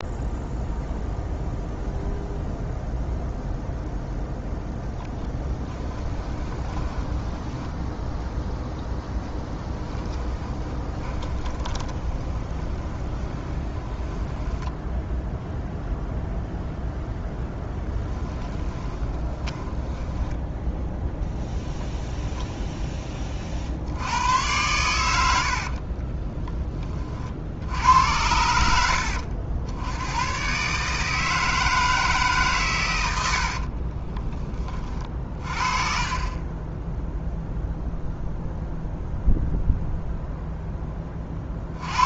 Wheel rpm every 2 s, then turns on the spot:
0, 0, 0, 10, 0, 20, 20, 10, 0, 20, 10, 0, 100, 20, 80, 140, 130, 20, 10, 0, 10.
6-8 10-16 18-20